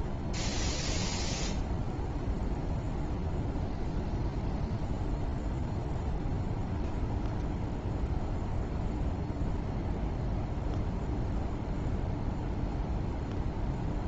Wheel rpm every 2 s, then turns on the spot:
0, 0, 0, 0, 0, 0, 0.
none